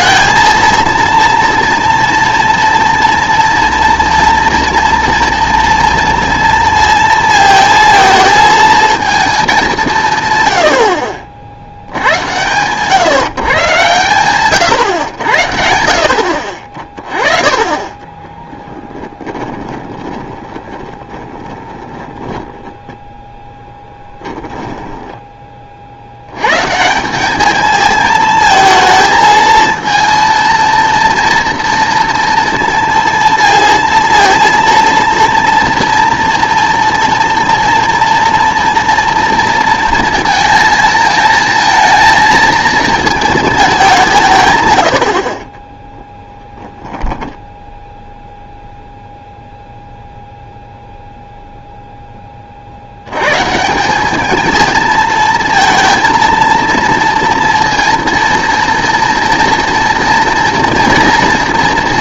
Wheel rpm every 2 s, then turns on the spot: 230, 230, 230, 230, 230, 70, 120, 120, 40, 10, 20, 0, 10, 150, 220, 230, 230, 230, 230, 230, 230, 220, 100, 10, 0, 0, 60, 220, 230, 230, 230.
18-22 24-26 46-48